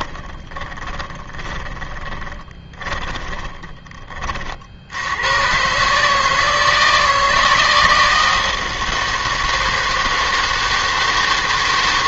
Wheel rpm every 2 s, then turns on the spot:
20, 20, 50, 160, 160, 160.
0-4